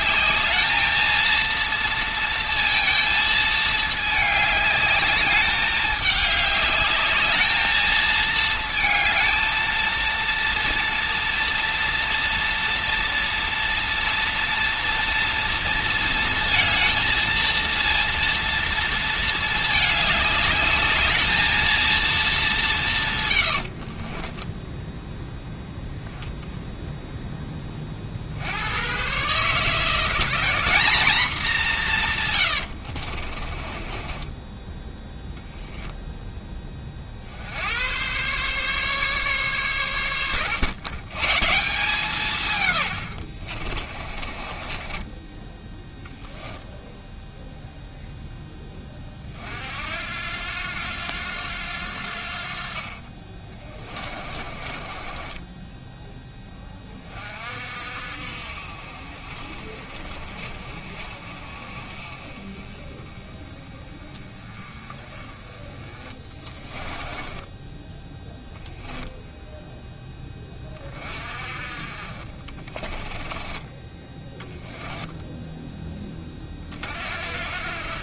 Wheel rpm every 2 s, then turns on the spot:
220, 230, 210, 210, 220, 230, 230, 230, 220, 230, 210, 180, 0, 0, 110, 210, 80, 10, 20, 140, 110, 130, 30, 0, 10, 90, 40, 30, 20, 50, 40, 20, 20, 20, 0, 30, 30, 10, 40.
32-36 44-46 54-56 66-68 72-76